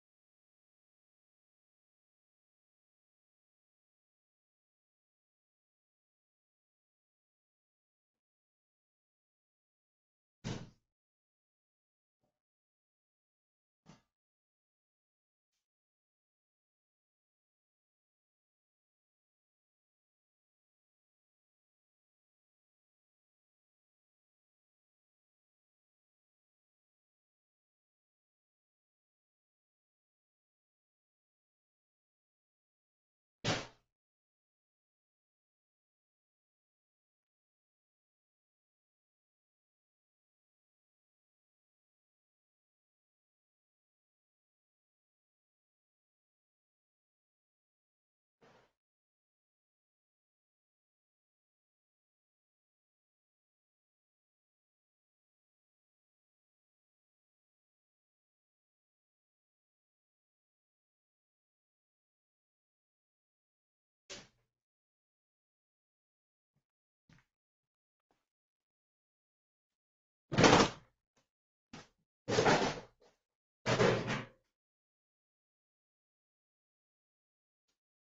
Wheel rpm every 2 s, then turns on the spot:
0, 0, 0, 0, 0, 0, 0, 0, 0, 0, 0, 0, 0, 0, 0, 0, 0, 0, 0, 0, 0, 0, 0, 0, 0, 0, 0, 0, 0, 0, 0, 0, 0, 0, 0, 0, 0, 0, 0.
none